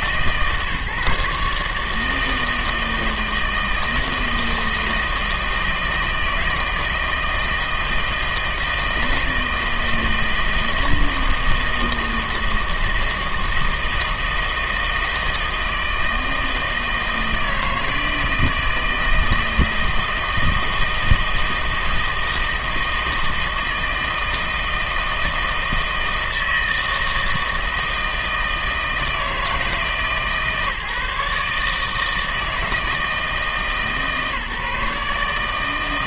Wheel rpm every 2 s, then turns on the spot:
150, 160, 160, 160, 160, 160, 160, 160, 160, 160, 160, 160, 160, 160, 160, 150, 160, 150.
none